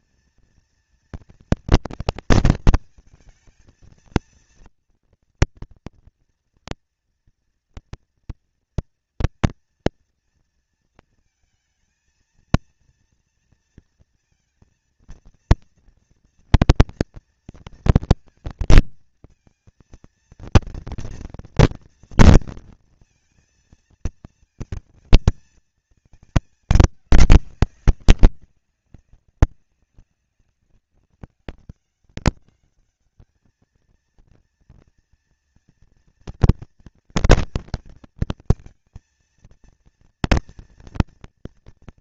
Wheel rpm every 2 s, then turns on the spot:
230, 230, 230, 230, 230, 220, 230, 230, 230, 220, 230, 230, 230, 210, 190, 200, 210, 230, 230, 230, 240.
none